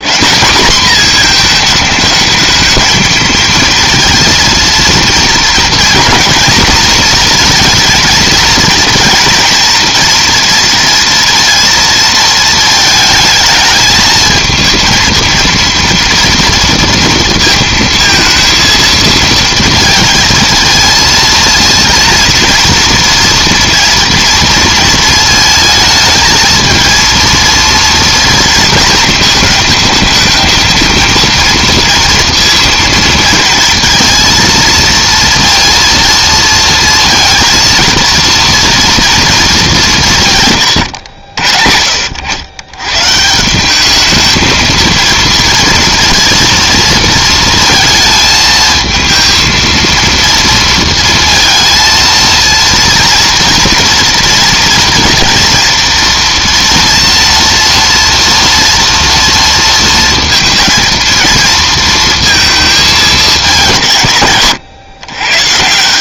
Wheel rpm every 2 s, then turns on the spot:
210, 220, 230, 240, 230, 230, 220, 220, 230, 230, 230, 240, 230, 230, 230, 220, 230, 230, 230, 230, 130, 110, 220, 230, 220, 230, 230, 230, 230, 230, 230, 220, 130.
none